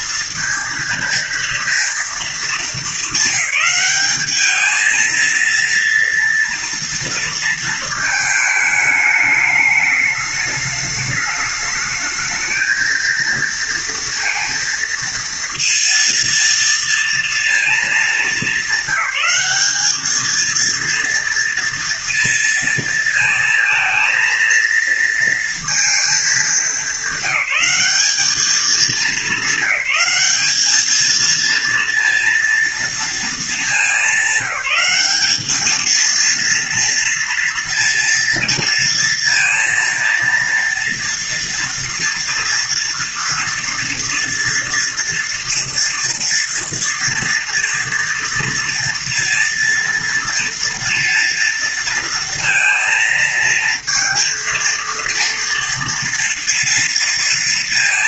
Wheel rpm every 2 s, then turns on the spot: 230, 200, 220, 230, 220, 210, 220, 230, 230, 210, 230, 230, 230, 210, 210, 210, 230, 200, 230, 230, 230, 230, 230, 230, 230, 230, 230, 230, 230.
none